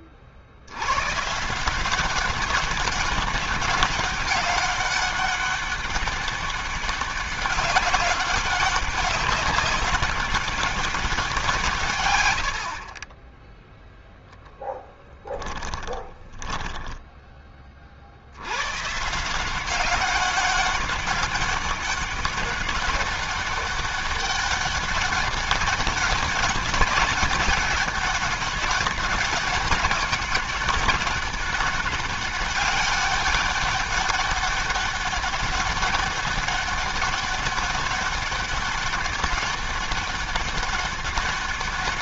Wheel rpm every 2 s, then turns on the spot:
80, 200, 200, 200, 200, 200, 50, 0, 20, 90, 200, 200, 200, 200, 200, 190, 200, 200, 200, 200, 200.
16-18